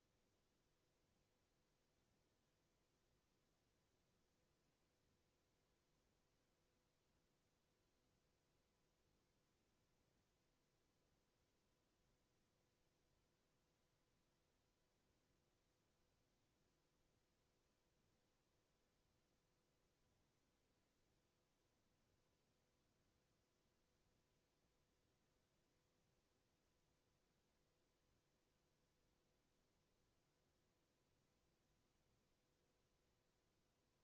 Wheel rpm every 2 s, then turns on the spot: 0, 0, 0, 0, 0, 0, 0, 0, 0, 0, 0, 0, 0, 0, 0, 0, 0.
none